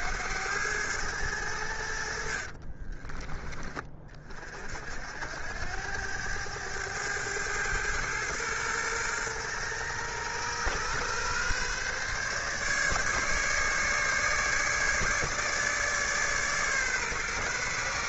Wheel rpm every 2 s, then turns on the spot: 100, 30, 60, 100, 120, 120, 150, 150, 140.
2-4